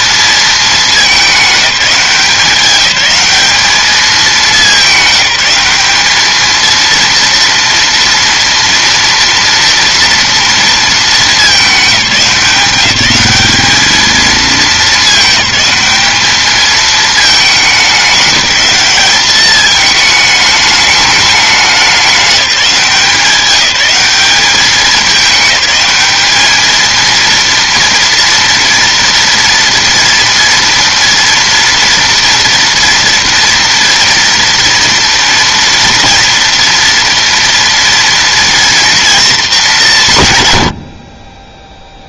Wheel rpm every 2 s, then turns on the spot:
220, 190, 210, 230, 230, 230, 190, 210, 210, 200, 210, 180, 200, 220, 230, 230, 230, 230, 230, 230, 110.
none